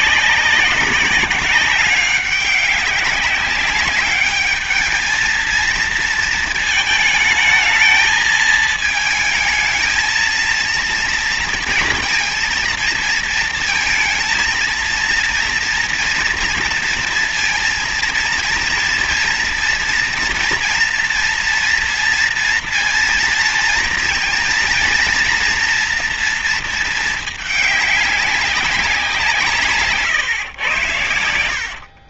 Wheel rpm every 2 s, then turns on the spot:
190, 200, 220, 220, 220, 230, 230, 230, 230, 230, 230, 230, 230, 230, 190, 110.
none